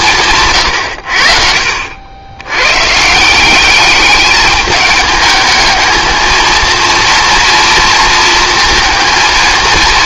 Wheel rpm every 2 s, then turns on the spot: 100, 130, 210, 230, 220.
none